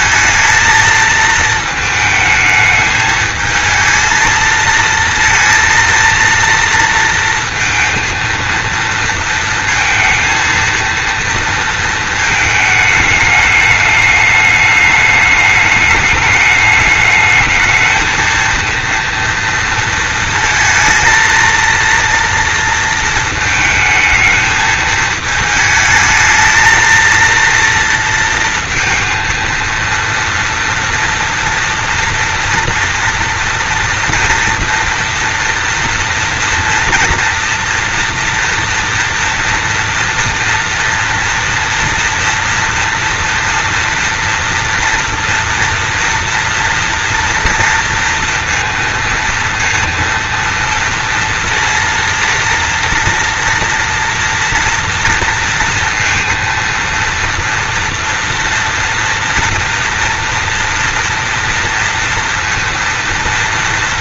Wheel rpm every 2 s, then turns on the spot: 220, 220, 230, 230, 230, 230, 210, 210, 210, 230, 230, 230, 220, 230, 230, 230, 230, 230, 230, 230, 230, 230, 230, 230, 230, 230, 230, 230, 230, 230, 230, 230.
none